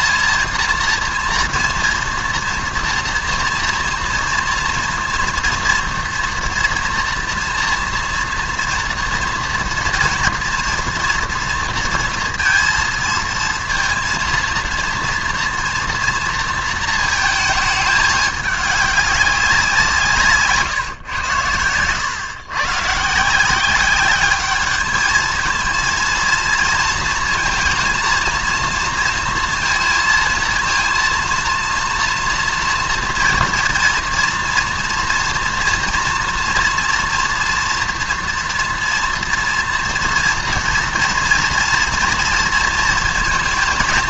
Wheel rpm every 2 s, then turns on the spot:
230, 230, 230, 230, 240, 240, 230, 230, 230, 200, 140, 140, 220, 220, 230, 230, 230, 230, 240, 230, 230, 230.
none